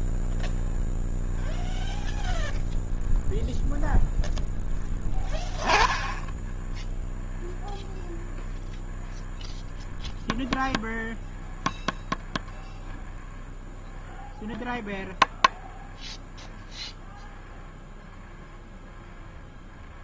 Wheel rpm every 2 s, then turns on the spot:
0, 0, 0, 20, 0, 0, 0, 0, 0, 0.
none